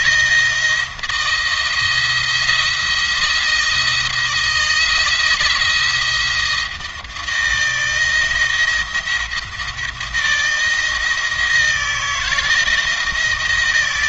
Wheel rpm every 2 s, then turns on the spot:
170, 170, 170, 170, 160, 160, 170.
none